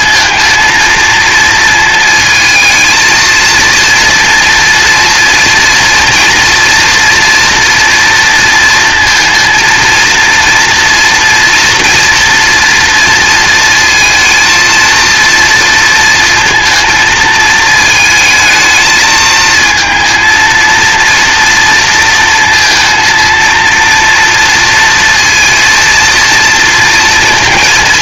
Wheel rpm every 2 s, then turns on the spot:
230, 230, 230, 230, 230, 240, 230, 230, 220, 220, 230, 230, 230, 230.
none